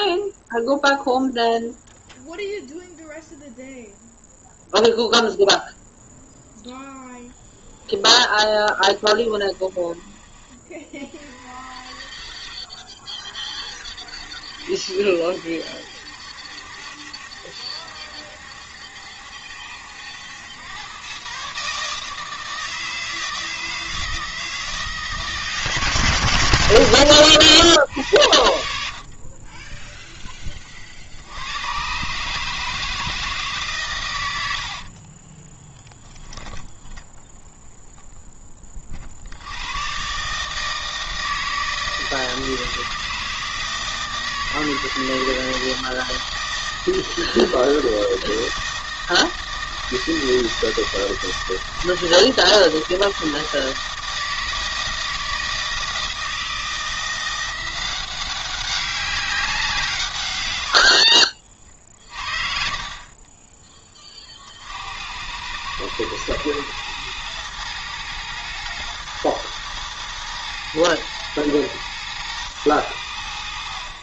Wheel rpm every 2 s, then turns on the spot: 0, 0, 0, 0, 20, 30, 40, 70, 70, 70, 110, 160, 160, 100, 70, 40, 160, 70, 10, 30, 160, 160, 160, 160, 160, 160, 160, 160, 160, 190, 90, 40, 60, 110, 110, 120, 100.
8-10 34-36 60-62